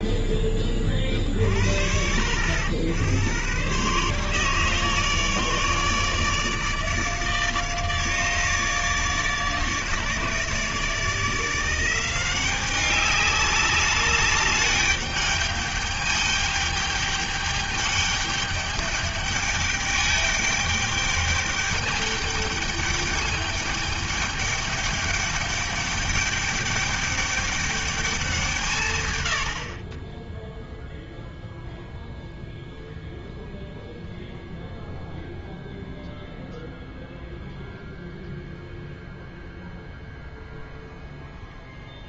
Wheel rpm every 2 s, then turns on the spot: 30, 90, 150, 150, 150, 160, 200, 200, 210, 210, 210, 210, 210, 210, 130, 0, 0, 0, 0, 0, 0.
none